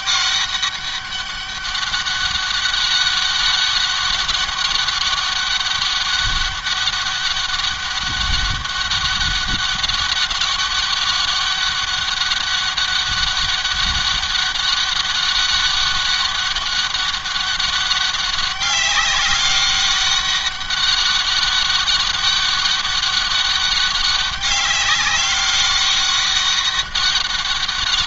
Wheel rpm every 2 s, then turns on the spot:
200, 200, 200, 200, 200, 200, 200, 190, 200, 200, 200, 200, 200, 200.
none